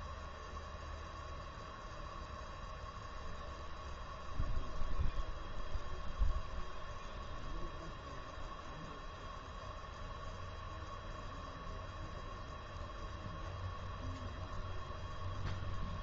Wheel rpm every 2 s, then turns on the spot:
0, 0, 0, 0, 0, 0, 0, 0.
none